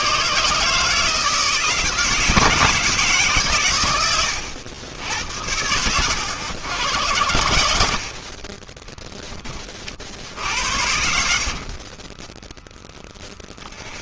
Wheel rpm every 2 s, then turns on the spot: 150, 160, 90, 110, 20, 70, 10.
10-12